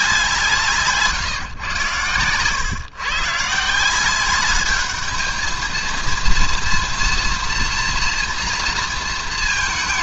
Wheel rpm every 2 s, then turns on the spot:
170, 130, 210, 230, 230.
none